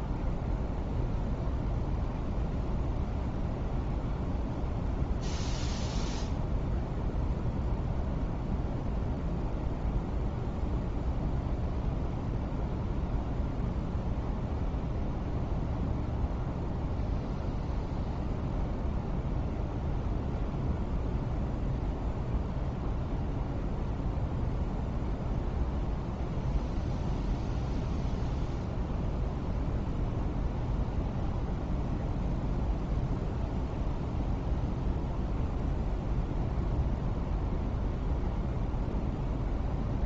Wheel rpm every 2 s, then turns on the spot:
0, 0, 0, 0, 0, 0, 0, 0, 0, 0, 0, 0, 0, 0, 0, 0, 0, 0, 0, 0.
none